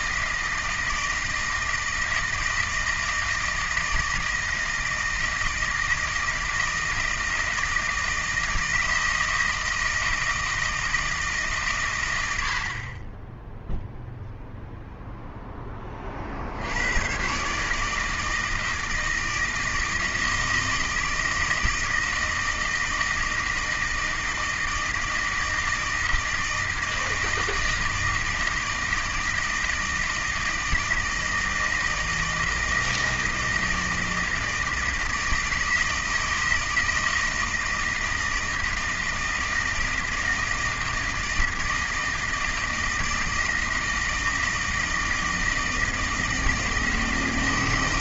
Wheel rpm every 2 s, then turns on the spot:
160, 160, 160, 160, 160, 160, 80, 0, 90, 160, 160, 160, 160, 160, 160, 160, 160, 160, 160, 160, 160, 160, 160, 160.
none